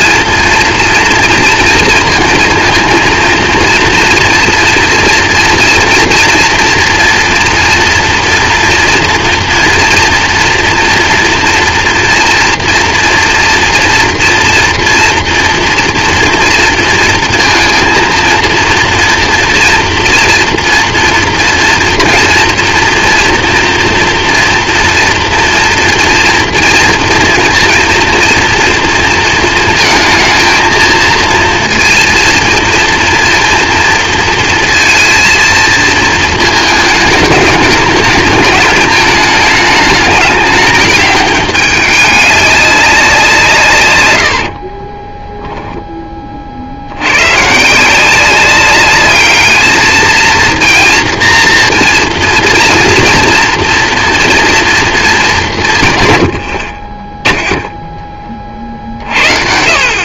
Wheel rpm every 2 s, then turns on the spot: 230, 220, 230, 230, 240, 230, 240, 240, 230, 230, 240, 230, 230, 230, 230, 220, 230, 230, 220, 210, 210, 200, 50, 70, 200, 230, 240, 230, 40, 50.
44-46